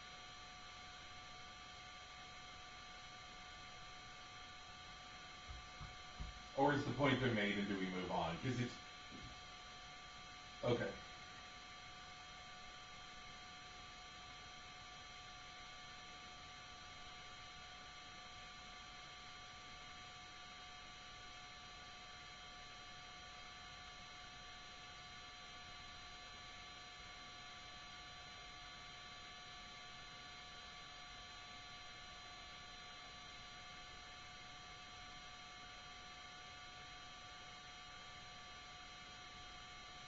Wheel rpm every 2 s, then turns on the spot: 0, 0, 0, 0, 0, 0, 0, 0, 0, 0, 0, 0, 0, 0, 0, 0, 0, 0, 0, 0.
none